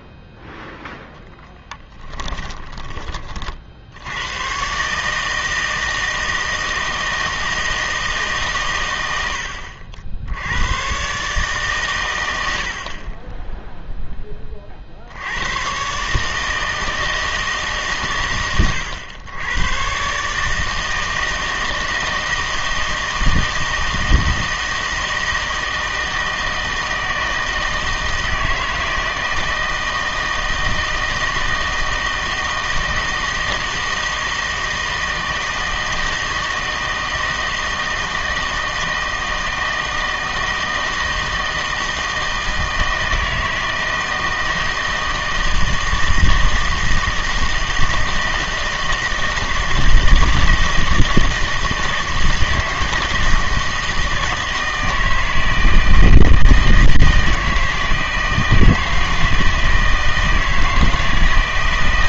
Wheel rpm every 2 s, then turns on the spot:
0, 20, 130, 160, 120, 100, 70, 40, 160, 110, 160, 160, 160, 160, 160, 160, 160, 160, 160, 160, 160, 160, 160, 160, 160, 160, 160, 160, 160, 160, 160.
2-4